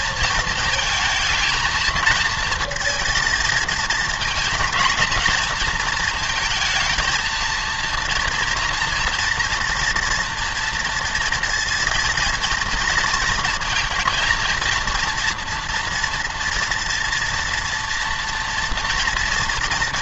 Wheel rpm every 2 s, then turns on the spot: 230, 220, 220, 230, 230, 230, 230, 230, 230, 240.
none